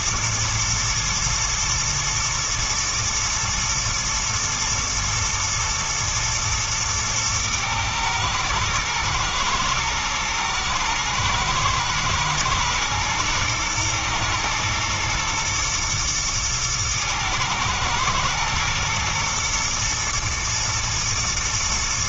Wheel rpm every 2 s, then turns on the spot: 110, 110, 110, 110, 110, 110, 120, 120, 110, 110, 110.
none